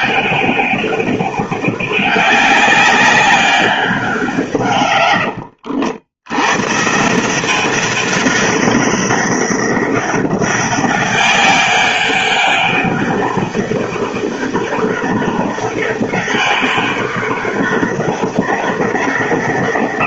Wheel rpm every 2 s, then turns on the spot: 200, 200, 140, 130, 200, 200, 200, 200, 200, 190.
none